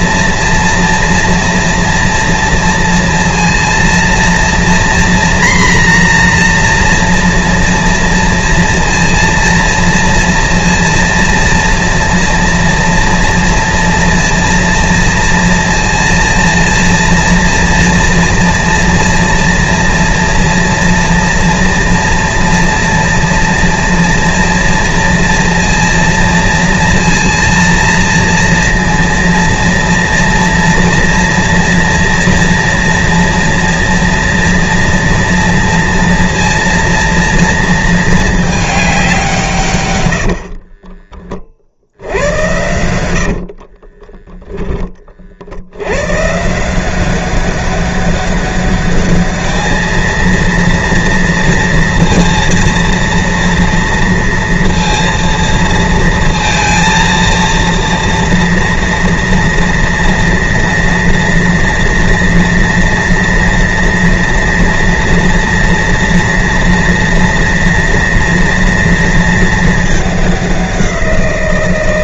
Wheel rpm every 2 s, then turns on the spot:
230, 230, 230, 240, 230, 230, 230, 230, 230, 230, 230, 230, 230, 230, 230, 230, 230, 230, 230, 210, 50, 90, 10, 150, 200, 230, 230, 230, 230, 230, 230, 230, 230, 230, 230, 190.
40-44